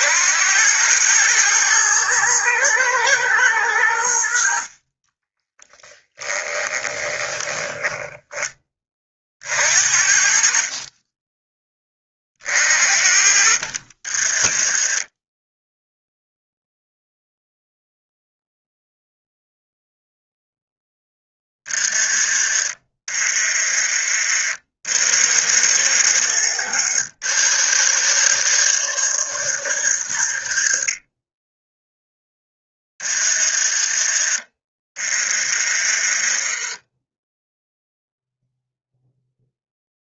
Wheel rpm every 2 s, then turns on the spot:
100, 110, 30, 10, 30, 30, 50, 10, 0, 0, 10, 40, 70, 90, 100, 30, 20, 20, 10, 0.
4-8 14-16 22-24